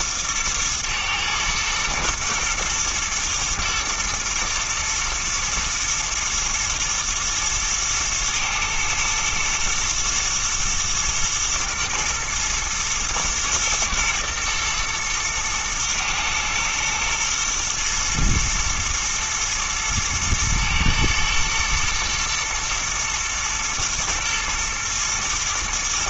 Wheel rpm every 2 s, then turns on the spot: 110, 120, 110, 120, 120, 110, 110, 110, 110, 110, 110, 120, 120.
none